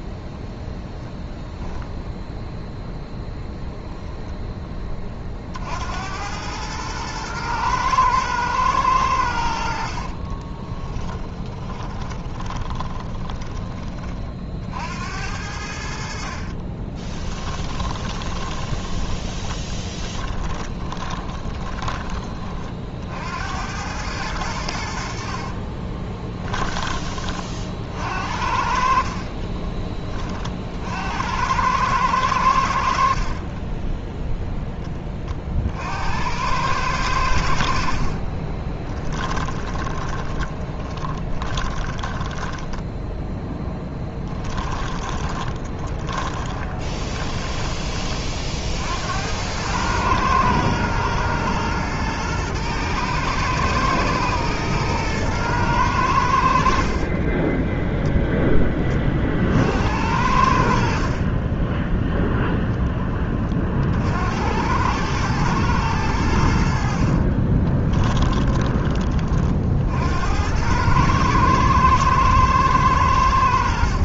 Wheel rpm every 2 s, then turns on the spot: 0, 10, 20, 110, 100, 10, 20, 60, 30, 20, 20, 50, 70, 30, 50, 60, 70, 10, 100, 30, 30, 10, 20, 20, 70, 110, 110, 120, 50, 20, 50, 0, 90, 60, 30, 100, 110.
2-4 10-14 16-22 38-42 44-48 66-68